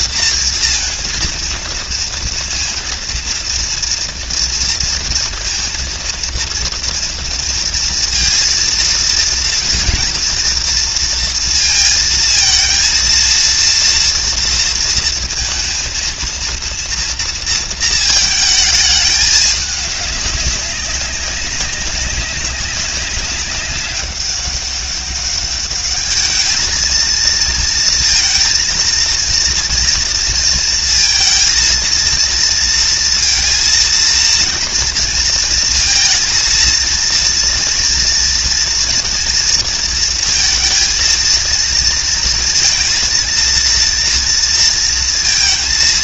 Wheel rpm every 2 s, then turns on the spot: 220, 230, 230, 230, 230, 230, 230, 230, 230, 220, 200, 190, 200, 220, 230, 230, 230, 230, 230, 230, 230, 230, 230.
none